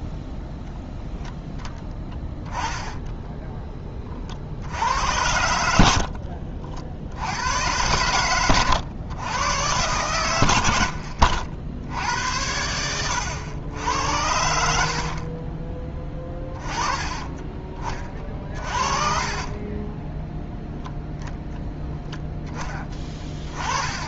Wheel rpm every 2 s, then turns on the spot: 0, 10, 60, 60, 110, 100, 90, 70, 20, 40, 0, 10.
2-4 6-8 18-20